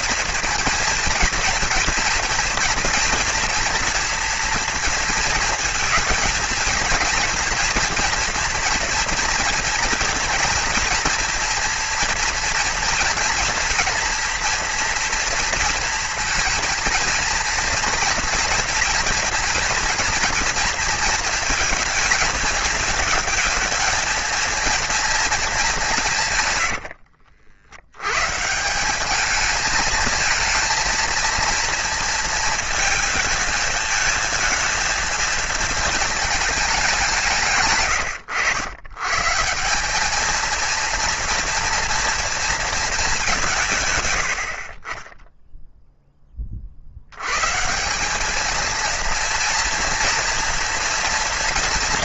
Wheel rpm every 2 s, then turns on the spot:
230, 230, 230, 230, 230, 230, 230, 240, 230, 240, 230, 220, 230, 80, 190, 220, 220, 230, 190, 110, 230, 230, 40, 70, 230, 230.
26-28